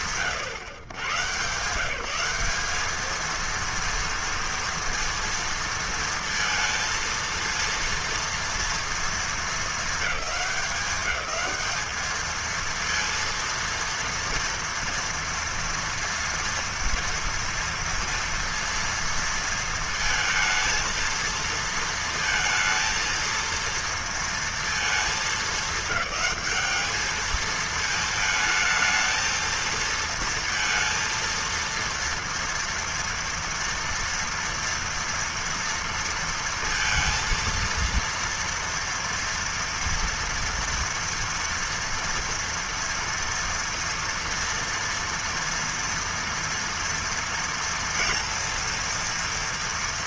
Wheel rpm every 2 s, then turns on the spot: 130, 220, 230, 230, 220, 190, 230, 230, 230, 230, 230, 230, 220, 220, 220, 230, 230, 230, 230, 230, 230, 230, 230, 230, 240.
none